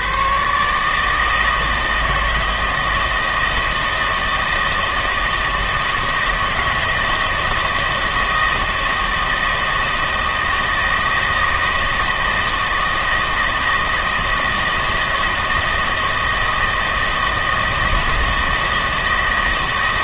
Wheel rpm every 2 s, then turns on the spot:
150, 160, 160, 160, 160, 160, 160, 160, 160, 160.
none